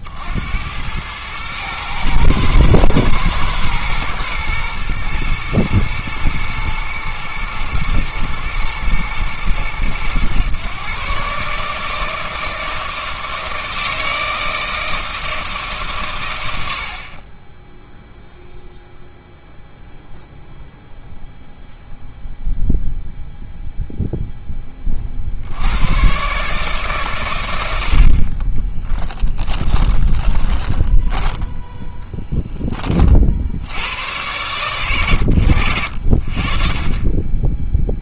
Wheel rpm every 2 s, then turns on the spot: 80, 110, 120, 120, 110, 120, 160, 160, 80, 0, 0, 0, 10, 150, 30, 20, 10, 110, 10.
30-32